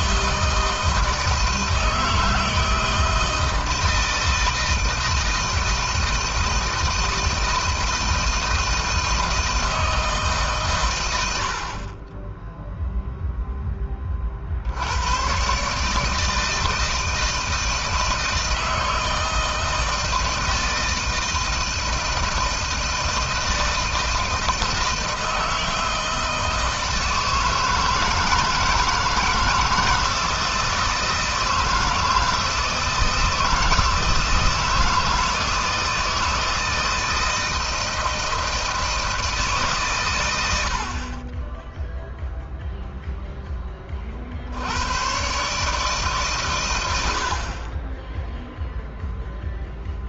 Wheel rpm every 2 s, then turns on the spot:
160, 160, 160, 160, 160, 130, 10, 70, 160, 160, 160, 160, 160, 160, 160, 160, 160, 160, 160, 160, 60, 0, 90, 100, 0.
none